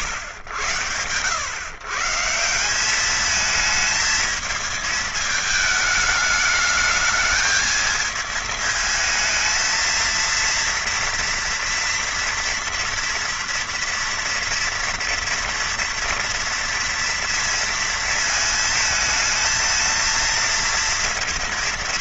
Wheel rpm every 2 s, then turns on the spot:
100, 180, 220, 210, 220, 230, 230, 230, 230, 220, 230.
none